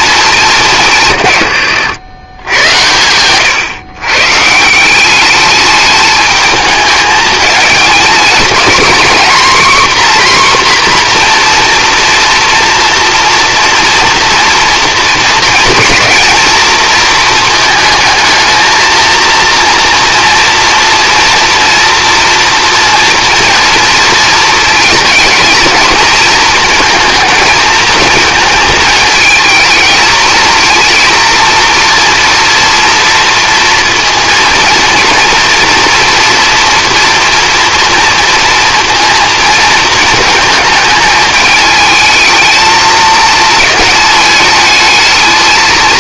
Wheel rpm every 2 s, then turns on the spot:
170, 90, 180, 220, 250, 250, 230, 230, 230, 230, 230, 230, 220, 230, 220, 230, 240, 230, 230, 230, 210, 220, 220.
none